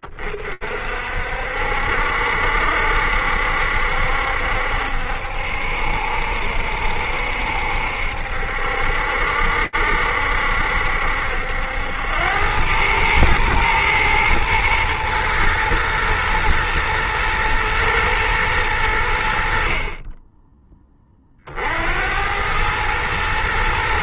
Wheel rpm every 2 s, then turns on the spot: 20, 70, 70, 60, 70, 70, 90, 110, 120, 110, 30, 100.
none